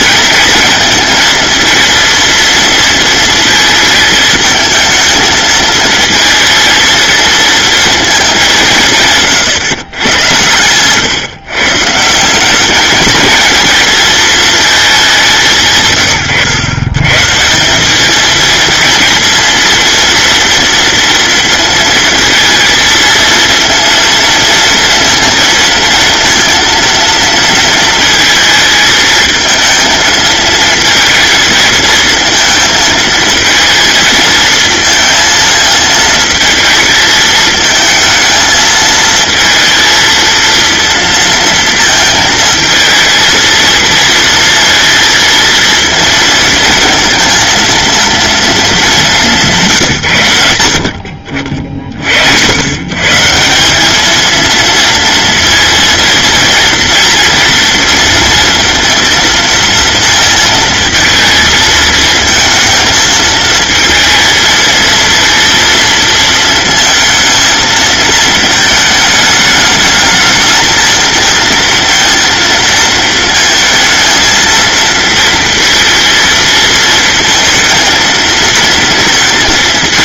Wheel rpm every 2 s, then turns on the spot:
230, 220, 220, 230, 140, 120, 210, 190, 130, 220, 230, 230, 230, 230, 220, 230, 220, 220, 220, 220, 230, 230, 220, 230, 200, 50, 150, 230, 230, 230, 230, 220, 230, 230, 220, 220, 230, 230, 230, 230.
none